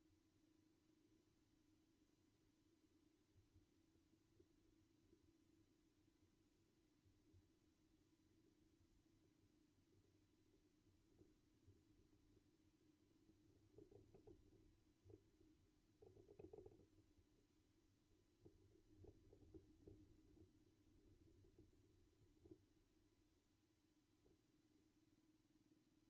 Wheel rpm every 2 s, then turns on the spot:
0, 0, 0, 0, 0, 0, 0, 0, 0, 0, 0, 0, 0.
none